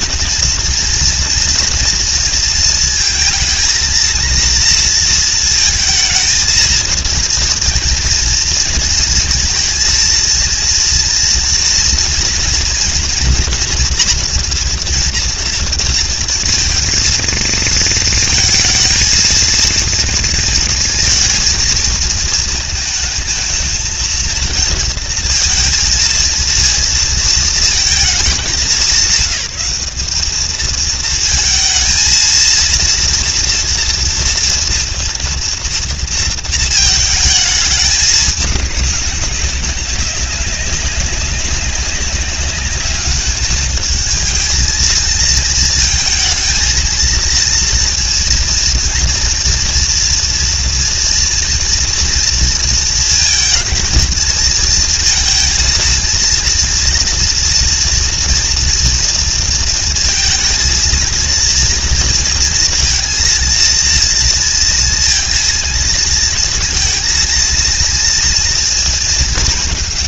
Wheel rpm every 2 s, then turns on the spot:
230, 230, 230, 230, 230, 230, 230, 230, 230, 230, 230, 220, 230, 230, 190, 220, 230, 230, 220, 200, 190, 200, 230, 230, 230, 240, 230, 230, 240, 230, 220, 230, 230, 230, 230.
none